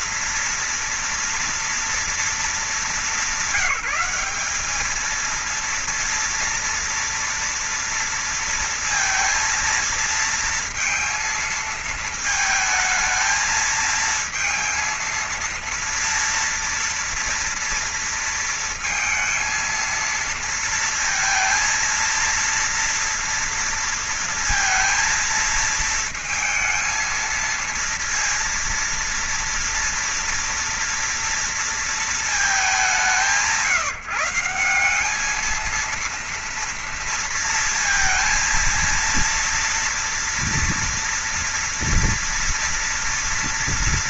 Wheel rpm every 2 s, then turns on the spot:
240, 220, 200, 230, 230, 230, 230, 230, 230, 230, 230, 230, 230, 230, 230, 230, 200, 160, 230, 230, 230, 230.
none